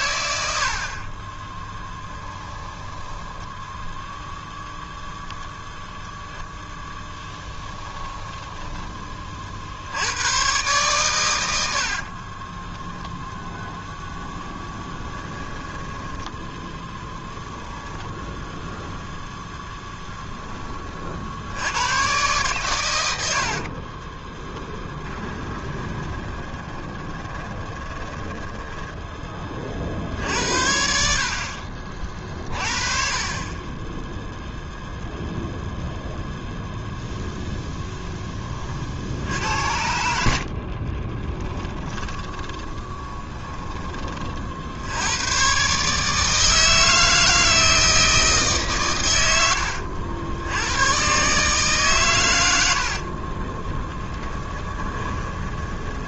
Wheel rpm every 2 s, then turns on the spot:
90, 10, 0, 0, 10, 100, 30, 0, 10, 0, 10, 120, 30, 20, 10, 60, 40, 0, 0, 10, 60, 30, 40, 150, 150, 80, 110, 10.
2-4 8-10 12-14 24-30 42-44 54-56